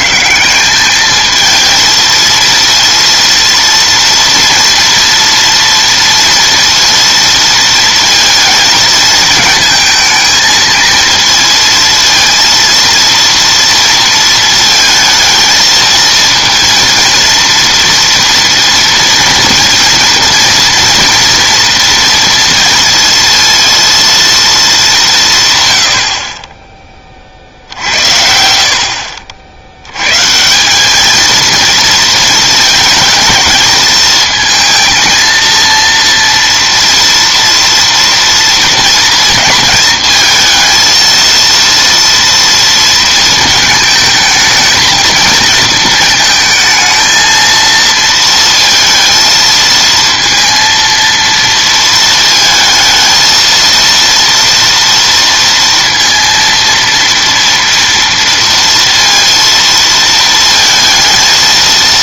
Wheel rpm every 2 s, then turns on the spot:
180, 230, 240, 230, 230, 220, 230, 230, 230, 230, 230, 230, 220, 30, 60, 180, 220, 220, 230, 230, 230, 230, 220, 220, 230, 230, 220, 230, 230, 230, 230.
none